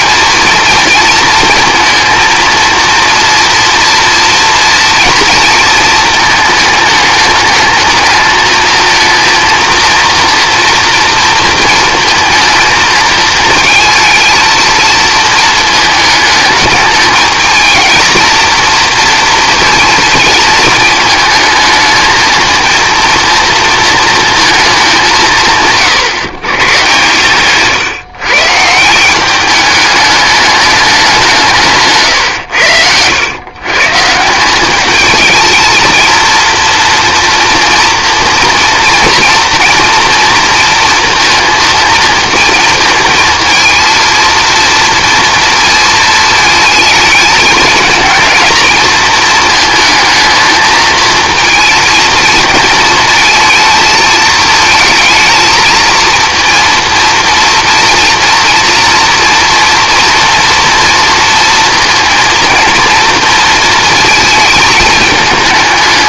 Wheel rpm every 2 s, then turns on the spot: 230, 230, 240, 220, 220, 240, 230, 220, 210, 230, 230, 230, 210, 130, 160, 200, 80, 200, 230, 230, 230, 230, 230, 220, 220, 220, 220, 220, 230, 230, 230, 230, 220.
none